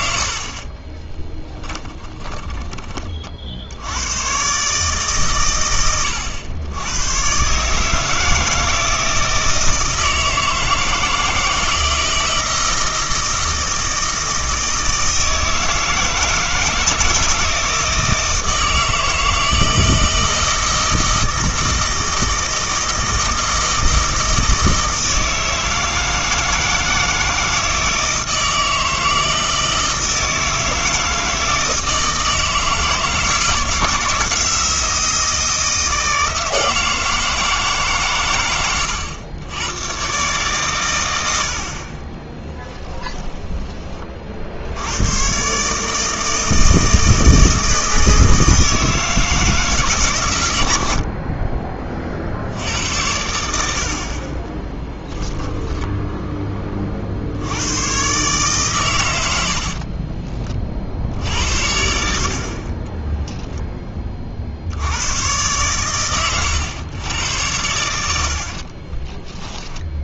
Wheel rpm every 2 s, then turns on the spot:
30, 20, 140, 100, 160, 160, 160, 160, 160, 160, 160, 160, 160, 160, 160, 160, 160, 170, 160, 100, 130, 10, 80, 160, 160, 90, 80, 20, 20, 130, 50, 30, 60, 110, 50.
0-2 42-44 54-56 68-70